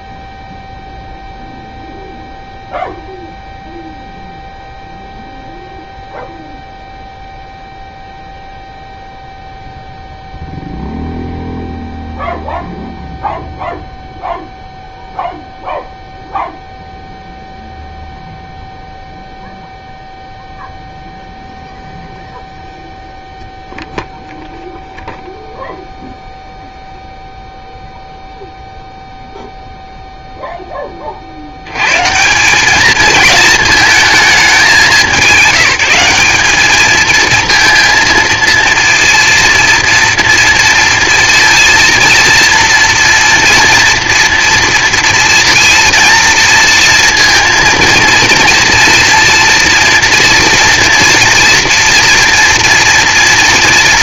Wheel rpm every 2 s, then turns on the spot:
0, 0, 0, 0, 0, 0, 0, 0, 0, 0, 0, 0, 0, 0, 0, 10, 200, 210, 210, 230, 230, 230, 230, 230, 230, 230, 230.
none